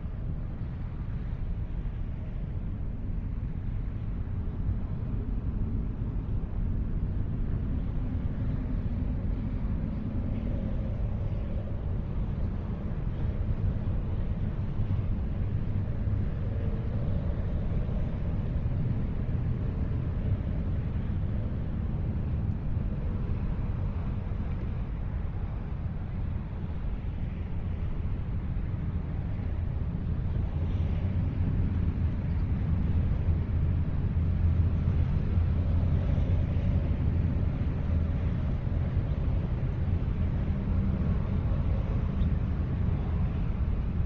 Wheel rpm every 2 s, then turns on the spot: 0, 0, 0, 0, 0, 0, 0, 0, 0, 0, 0, 0, 0, 0, 0, 0, 0, 0, 0, 0, 0, 0.
none